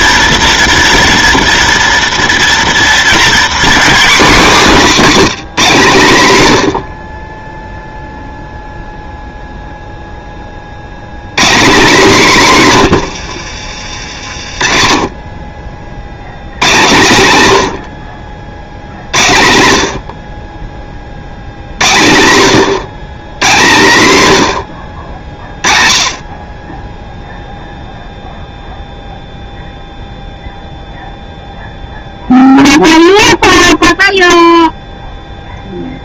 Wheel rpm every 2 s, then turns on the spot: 230, 240, 240, 110, 0, 40, 190, 50, 120, 70, 30, 120, 90, 20, 0, 0, 0, 0.
14-16